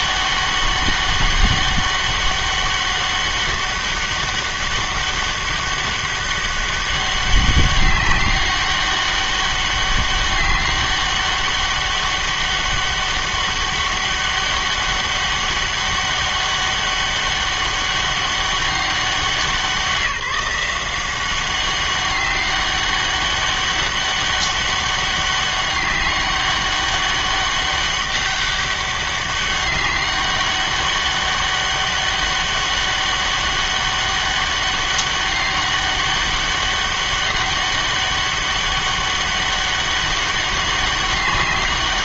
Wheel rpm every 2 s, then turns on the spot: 200, 200, 200, 200, 200, 200, 200, 200, 200, 200, 180, 200, 200, 200, 200, 200, 200, 200, 200, 200, 200.
none